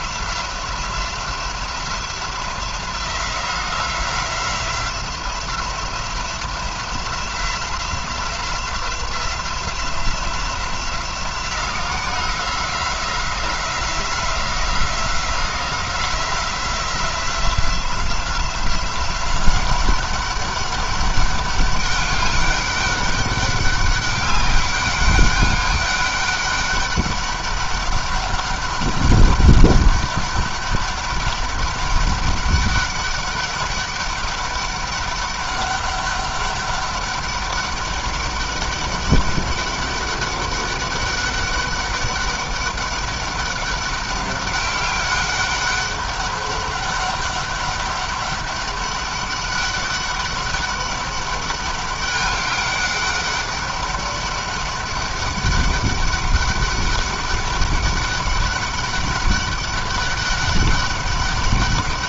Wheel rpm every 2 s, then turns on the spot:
180, 180, 180, 180, 180, 180, 180, 180, 180, 180, 200, 200, 200, 200, 200, 200, 200, 200, 200, 200, 200, 200, 200, 200, 200, 200, 200, 200, 200, 200, 200.
none